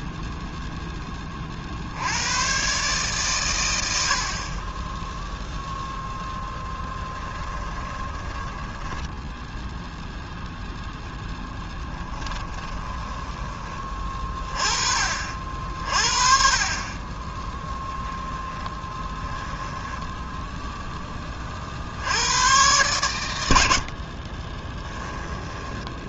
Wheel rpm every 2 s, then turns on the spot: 0, 120, 40, 10, 10, 0, 20, 30, 40, 10, 0, 100, 30.
8-10 12-14 18-20 24-26